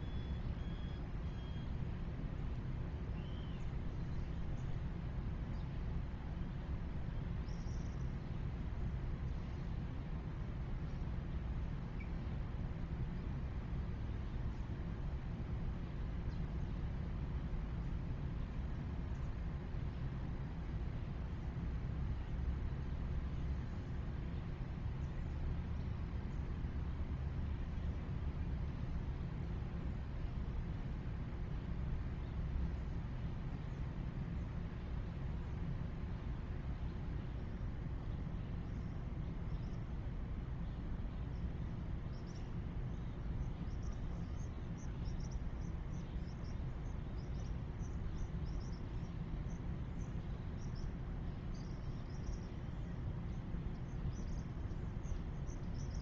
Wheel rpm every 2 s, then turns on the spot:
0, 0, 0, 0, 0, 0, 0, 0, 0, 0, 0, 0, 0, 0, 0, 0, 0, 0, 0, 0, 0, 0, 0, 0, 0, 0, 0, 0.
none